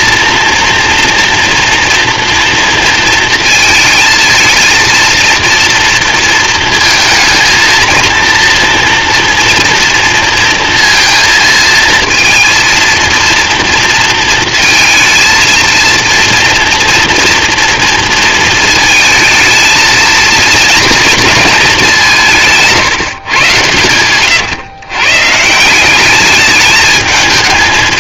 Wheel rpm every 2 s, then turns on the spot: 230, 230, 230, 230, 230, 230, 230, 230, 230, 230, 220, 160, 130, 210.
none